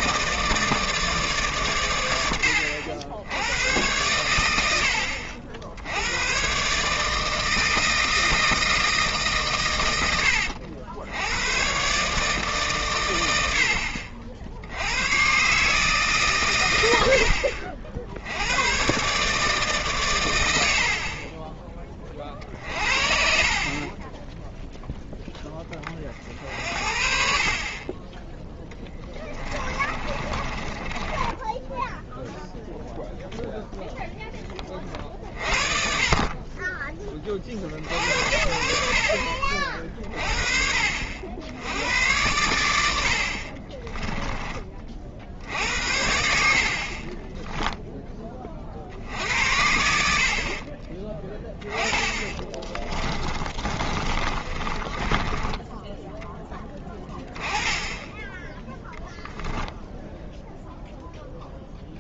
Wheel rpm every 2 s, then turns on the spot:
160, 90, 70, 140, 160, 80, 140, 80, 100, 110, 70, 50, 0, 60, 10, 20, 0, 30, 30, 70, 60, 90, 30, 50, 50, 40, 20, 20, 10, 10, 0.
22-24 30-32 50-56